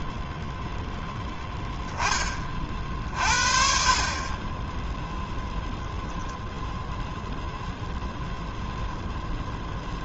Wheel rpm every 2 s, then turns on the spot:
0, 50, 0, 0, 0.
none